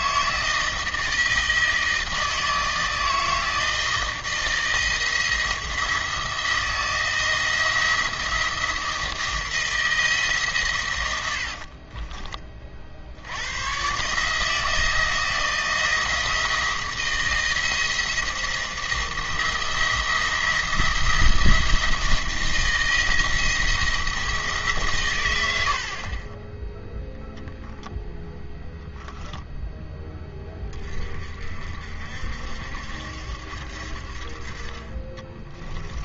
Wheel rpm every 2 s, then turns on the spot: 160, 160, 160, 160, 170, 130, 40, 160, 160, 170, 170, 170, 140, 10, 10, 30, 70, 40.
none